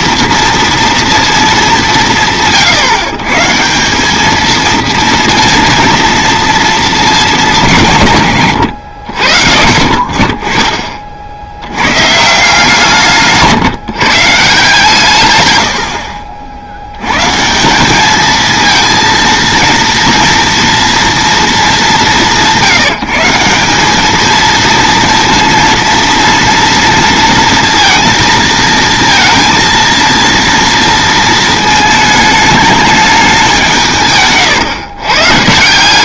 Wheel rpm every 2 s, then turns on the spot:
230, 150, 230, 220, 100, 40, 160, 160, 80, 230, 230, 170, 230, 230, 230, 230, 210, 130.
none